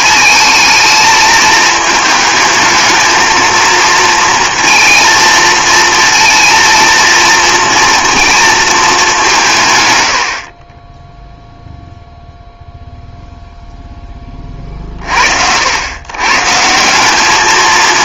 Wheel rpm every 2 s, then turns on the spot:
220, 220, 230, 230, 220, 40, 0, 30, 140.
none